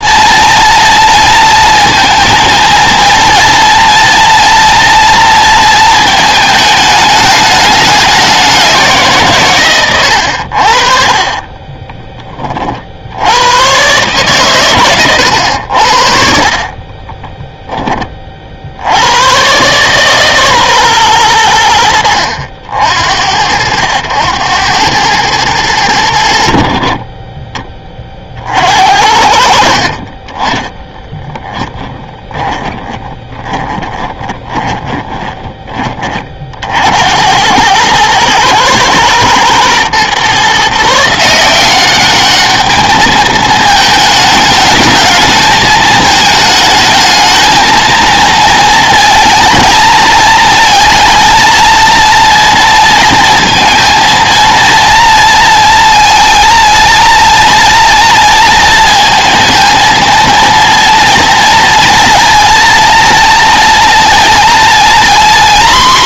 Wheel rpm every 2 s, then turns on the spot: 230, 230, 240, 220, 190, 70, 40, 120, 40, 60, 130, 70, 100, 50, 60, 20, 20, 30, 60, 110, 150, 210, 210, 220, 230, 230, 230, 230, 230, 230, 230, 230, 230.
16-18 32-36